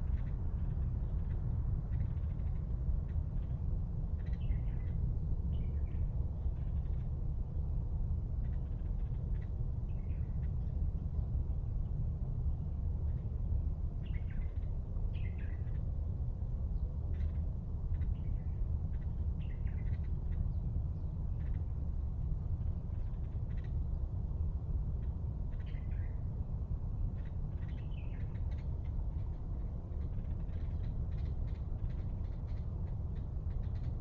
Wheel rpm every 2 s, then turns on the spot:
0, 0, 0, 0, 0, 0, 0, 0, 0, 0, 0, 0, 0, 0, 0, 0, 0.
none